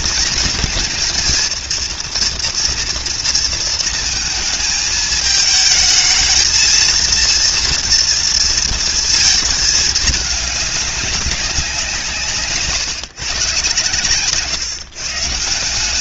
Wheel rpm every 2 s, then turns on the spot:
230, 230, 220, 230, 230, 210, 150, 160.
none